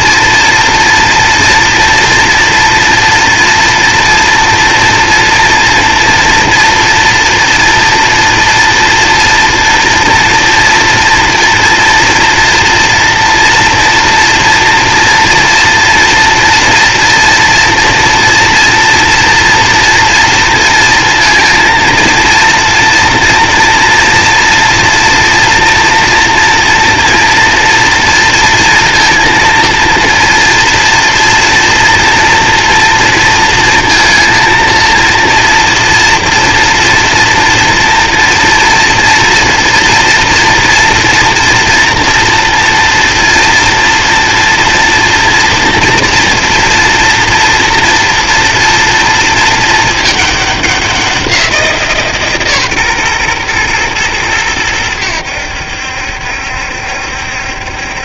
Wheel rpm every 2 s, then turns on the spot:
240, 230, 230, 230, 230, 230, 230, 230, 240, 230, 230, 230, 230, 230, 230, 230, 230, 230, 230, 240, 230, 230, 230, 240, 230, 200, 140, 100, 70.
none